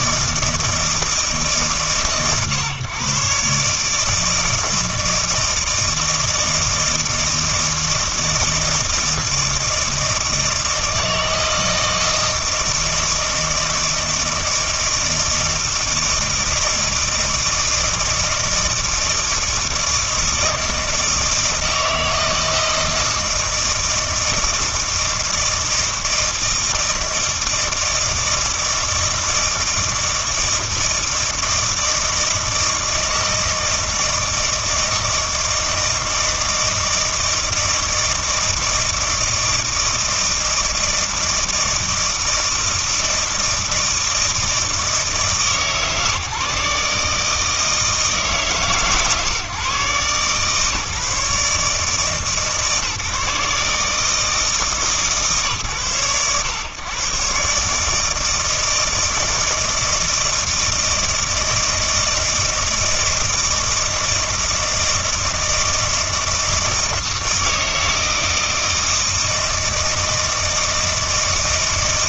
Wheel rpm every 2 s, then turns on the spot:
160, 130, 160, 160, 160, 160, 160, 160, 160, 160, 160, 160, 160, 160, 160, 160, 160, 160, 160, 160, 160, 160, 160, 140, 140, 150, 150, 160, 110, 160, 160, 160, 160, 160, 160, 160.
none